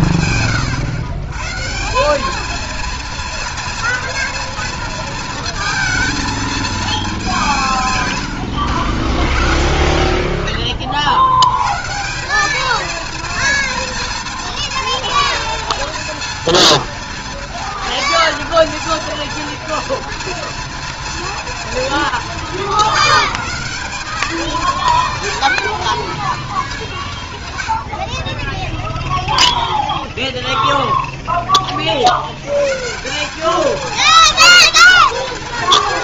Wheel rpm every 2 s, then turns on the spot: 110, 230, 230, 190, 30, 100, 230, 230, 230, 230, 210, 180, 240, 110, 0, 20, 210, 240.
none